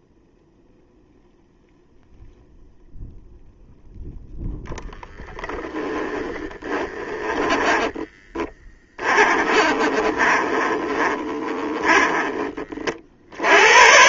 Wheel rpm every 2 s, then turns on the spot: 0, 0, 0, 20, 20, 20, 50.
6-12